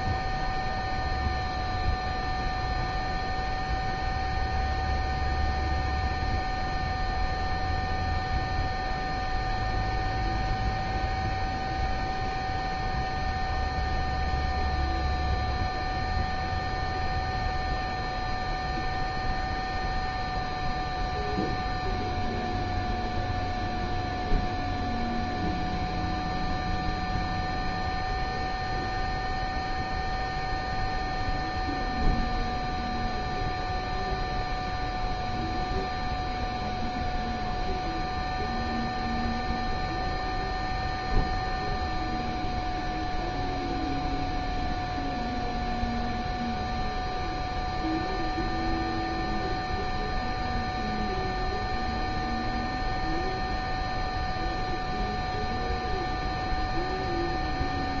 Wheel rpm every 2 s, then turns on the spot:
0, 0, 0, 0, 0, 0, 0, 0, 0, 0, 0, 0, 0, 0, 0, 0, 0, 0, 0, 0, 0, 0, 0, 0, 0, 0, 0, 0, 0.
none